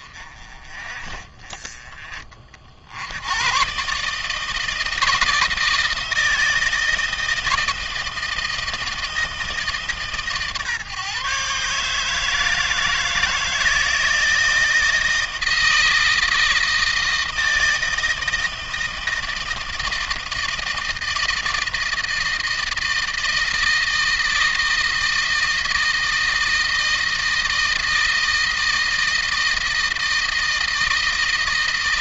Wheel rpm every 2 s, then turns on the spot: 30, 80, 160, 160, 160, 140, 160, 160, 160, 160, 160, 160, 160, 160, 160, 160.
none